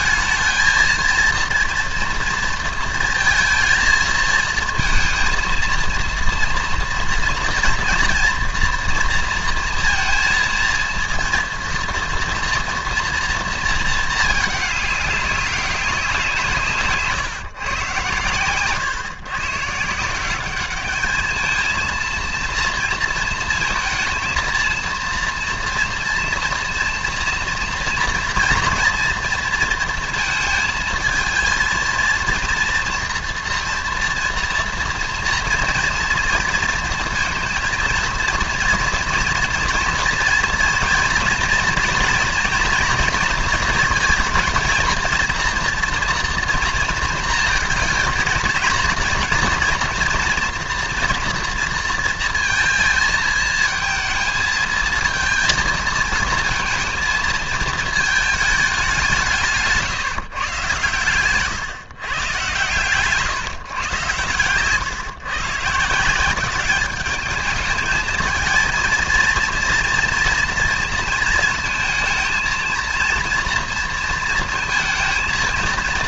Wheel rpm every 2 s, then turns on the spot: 220, 230, 230, 230, 230, 230, 230, 210, 150, 120, 200, 230, 230, 230, 230, 220, 230, 230, 230, 230, 230, 230, 230, 230, 220, 240, 220, 230, 230, 200, 120, 140, 120, 200, 230, 230, 230, 230.
none